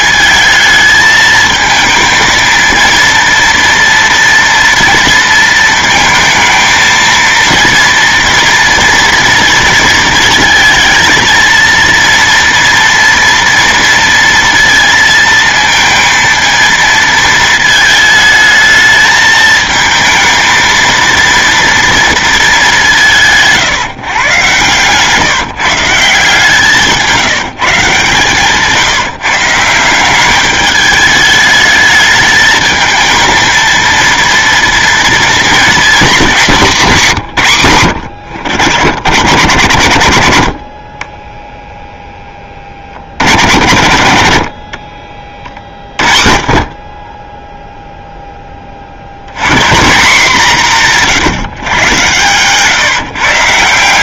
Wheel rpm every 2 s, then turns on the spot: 220, 230, 230, 220, 230, 230, 230, 230, 230, 220, 230, 210, 130, 160, 150, 200, 220, 230, 200, 90, 50, 30, 60, 40, 30, 170, 140.
26-28